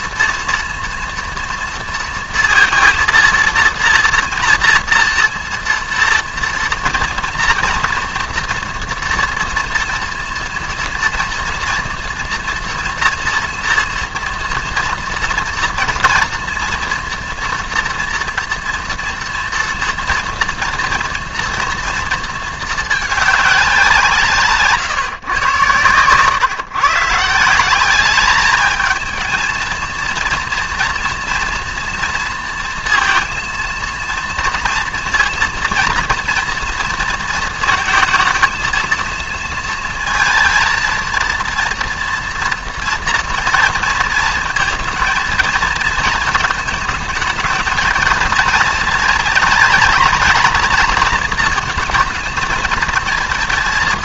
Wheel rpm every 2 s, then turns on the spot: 230, 230, 230, 230, 230, 230, 230, 240, 230, 230, 230, 220, 150, 140, 220, 230, 230, 230, 230, 230, 230, 240, 220, 230, 230, 220, 230.
none